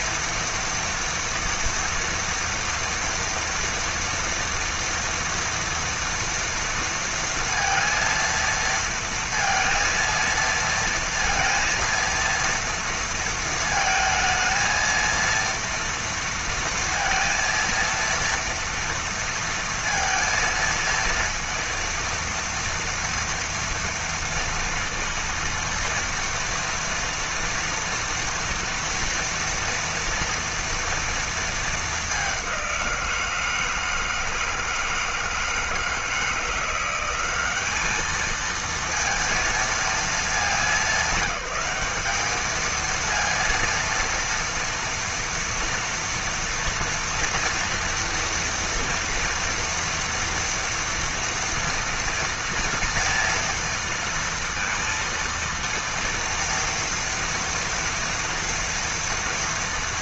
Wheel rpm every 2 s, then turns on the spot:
230, 230, 240, 230, 230, 230, 230, 230, 230, 230, 230, 230, 230, 230, 230, 230, 190, 160, 170, 220, 210, 210, 230, 230, 230, 230, 230, 230, 230, 230.
none